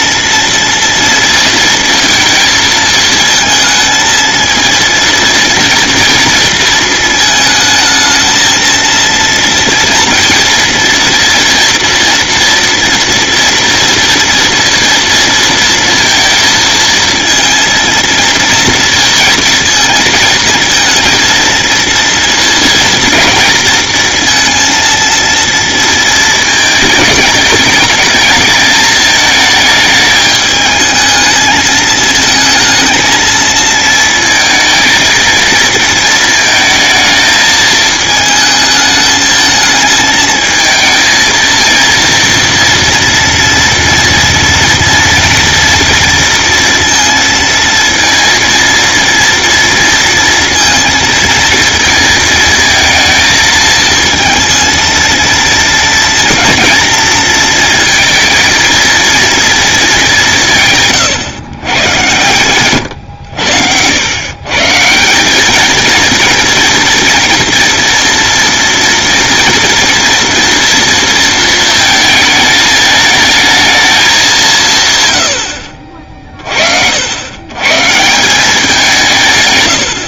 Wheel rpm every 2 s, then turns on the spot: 230, 220, 230, 230, 220, 230, 230, 230, 220, 230, 220, 240, 230, 220, 220, 220, 220, 230, 220, 220, 220, 230, 230, 230, 230, 230, 230, 230, 230, 230, 170, 120, 140, 230, 230, 240, 220, 170, 60, 180.
none